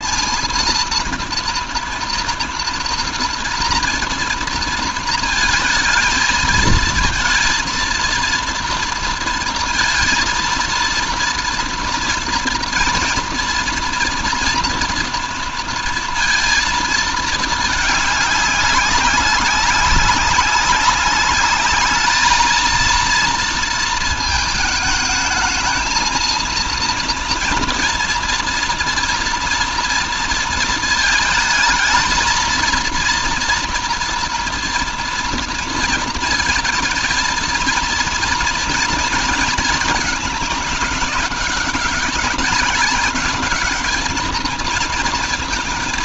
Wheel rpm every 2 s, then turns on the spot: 230, 230, 230, 230, 230, 230, 230, 230, 230, 200, 200, 230, 220, 230, 230, 220, 230, 230, 230, 230, 210, 200, 230.
none